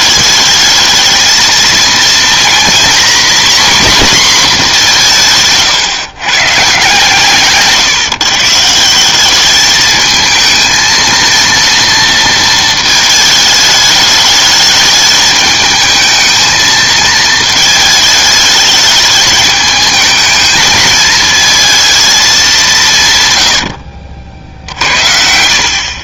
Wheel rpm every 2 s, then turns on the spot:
220, 240, 210, 140, 150, 220, 220, 210, 220, 210, 220, 180, 60.
none